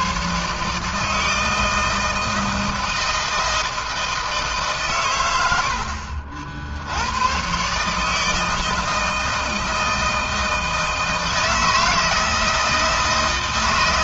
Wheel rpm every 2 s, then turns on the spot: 150, 160, 130, 80, 160, 160, 160.
none